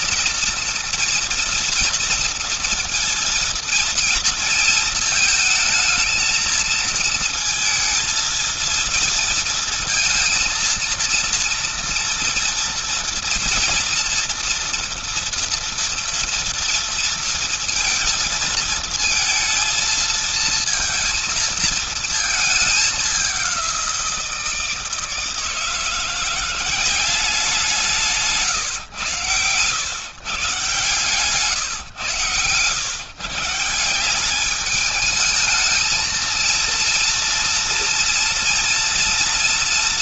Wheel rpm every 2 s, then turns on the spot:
230, 230, 230, 230, 230, 230, 230, 230, 230, 220, 230, 210, 160, 180, 140, 150, 120, 210, 230, 230.
none